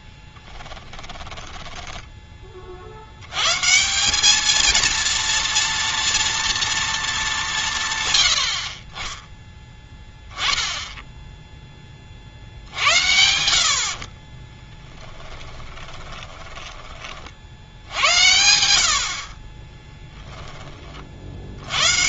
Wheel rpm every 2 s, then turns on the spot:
10, 50, 220, 230, 50, 10, 50, 10, 10, 80, 20.
0-2 16-18